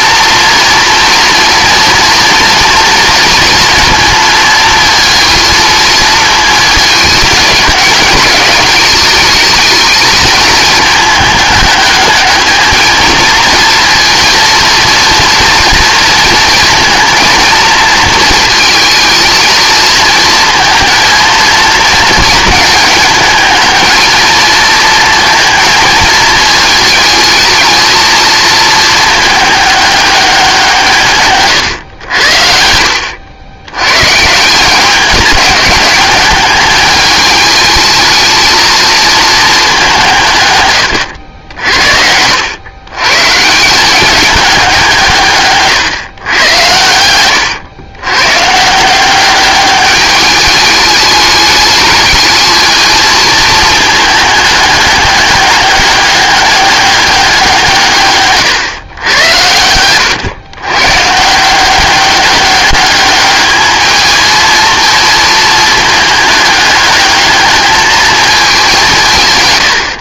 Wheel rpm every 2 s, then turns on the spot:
230, 230, 220, 220, 210, 220, 220, 230, 230, 220, 230, 220, 230, 220, 220, 160, 80, 190, 210, 230, 110, 120, 180, 90, 170, 210, 220, 200, 200, 130, 130, 200, 230, 210, 190.
32-34